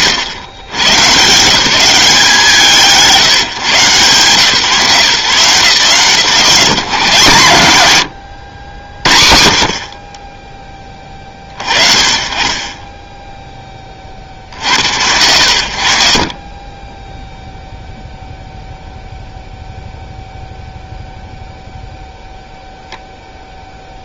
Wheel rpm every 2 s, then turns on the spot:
100, 160, 150, 180, 70, 20, 20, 70, 10, 0, 0, 0.
16-18